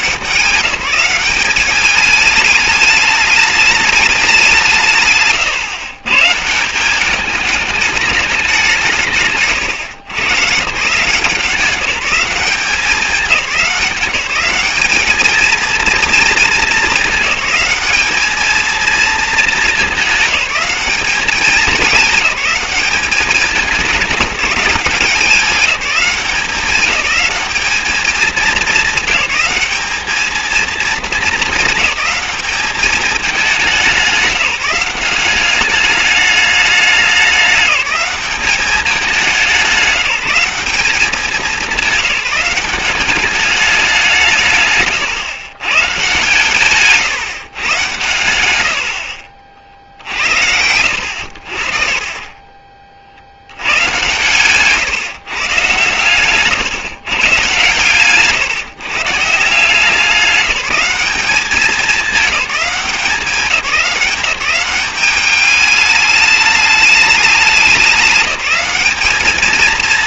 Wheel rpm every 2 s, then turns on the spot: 190, 210, 180, 170, 190, 120, 190, 200, 220, 220, 200, 190, 190, 190, 200, 220, 210, 190, 210, 200, 190, 190, 140, 140, 110, 80, 30, 140, 140, 150, 190, 190, 180, 210, 200.
none